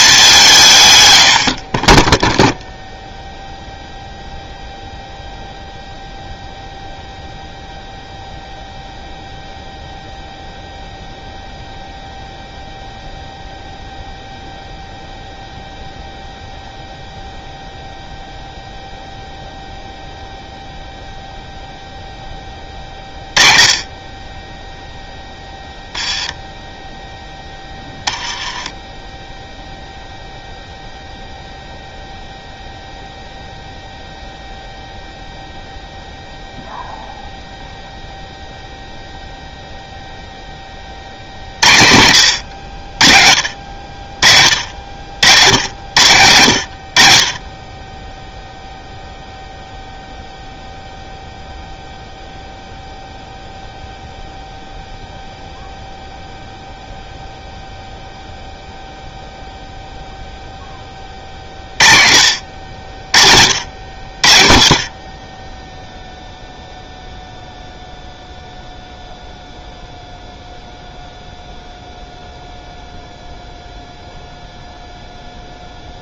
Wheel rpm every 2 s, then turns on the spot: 160, 0, 0, 0, 0, 0, 0, 0, 0, 0, 0, 10, 10, 0, 10, 0, 0, 0, 0, 0, 30, 70, 60, 80, 0, 0, 0, 0, 0, 0, 20, 50, 50, 0, 0, 0, 0, 0.
none